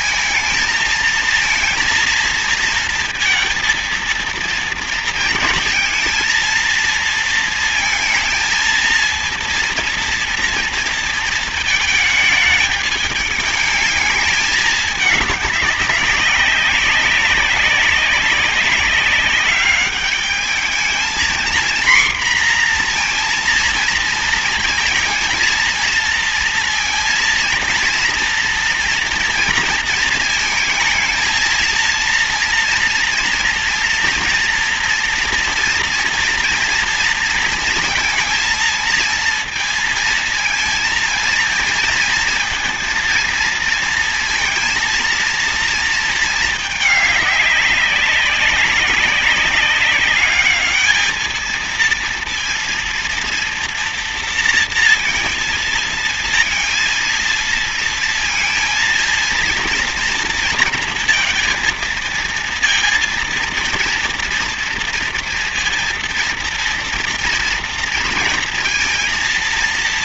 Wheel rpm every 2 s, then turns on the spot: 220, 230, 230, 230, 220, 230, 210, 210, 200, 200, 220, 240, 230, 230, 230, 230, 230, 230, 230, 230, 230, 220, 230, 210, 200, 210, 230, 230, 230, 230, 230, 230, 230, 230, 230.
none